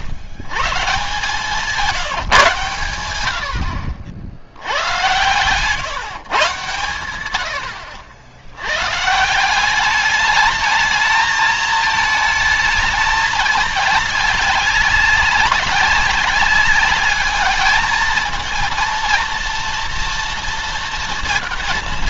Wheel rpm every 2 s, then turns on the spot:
130, 120, 100, 110, 110, 210, 220, 200, 200, 230, 230.
none